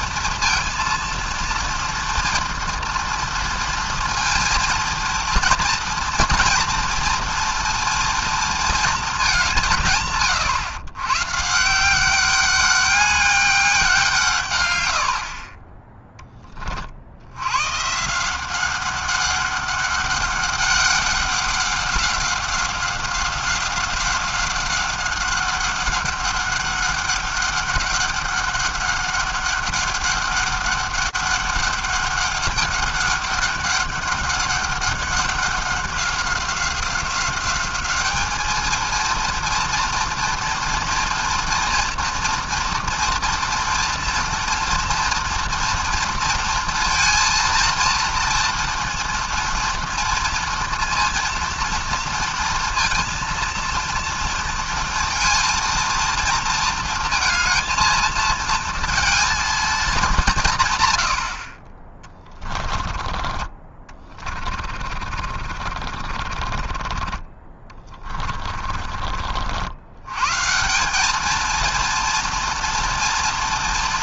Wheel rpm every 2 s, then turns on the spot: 230, 230, 230, 230, 230, 150, 180, 180, 10, 140, 200, 190, 190, 200, 200, 200, 200, 200, 190, 200, 230, 230, 230, 230, 230, 230, 230, 230, 230, 230, 200, 20, 40, 50, 30, 90, 230.
64-70